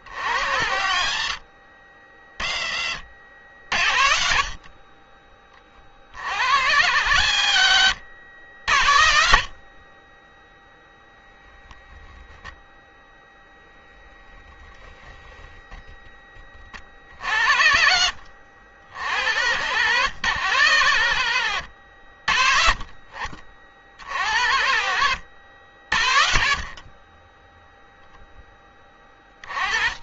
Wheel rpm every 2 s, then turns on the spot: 60, 40, 60, 70, 80, 20, 0, 0, 20, 60, 100, 50, 70, 50, 10.
none